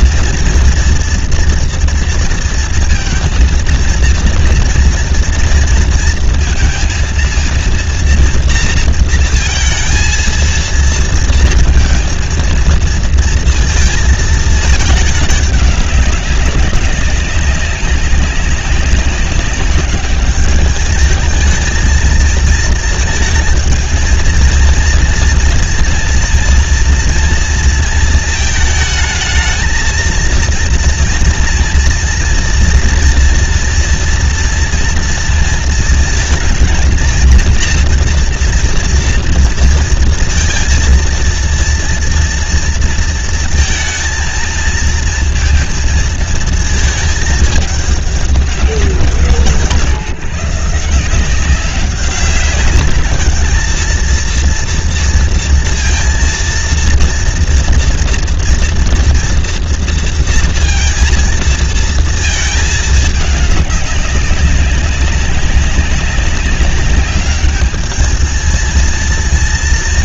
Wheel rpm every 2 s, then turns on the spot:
240, 230, 230, 230, 230, 230, 230, 220, 200, 190, 210, 220, 220, 240, 220, 220, 230, 240, 230, 230, 230, 230, 230, 230, 200, 160, 200, 230, 230, 230, 230, 220, 200, 190, 220.
none